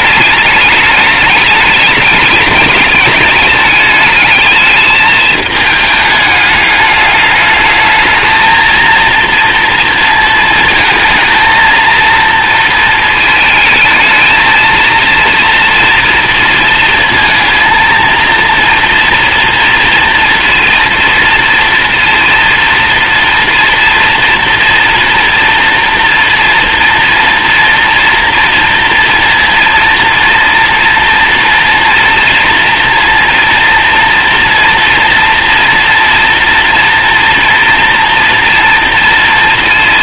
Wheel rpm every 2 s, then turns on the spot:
210, 210, 210, 210, 230, 220, 230, 230, 230, 240, 240, 230, 230, 230, 230, 230, 230, 240, 230, 230.
none